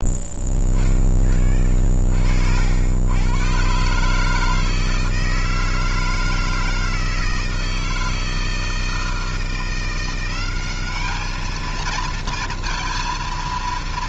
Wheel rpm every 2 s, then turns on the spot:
10, 80, 160, 160, 160, 200, 230.
none